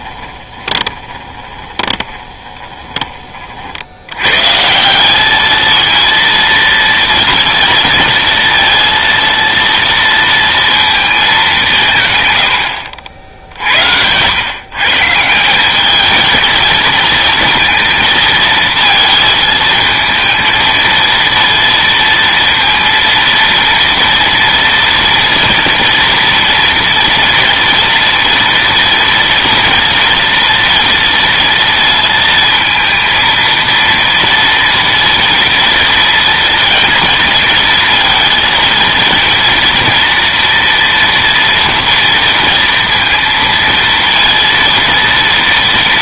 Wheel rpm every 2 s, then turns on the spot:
20, 20, 150, 230, 230, 230, 100, 130, 220, 220, 230, 230, 230, 230, 230, 230, 230, 230, 230, 230, 240, 230, 230.
0-4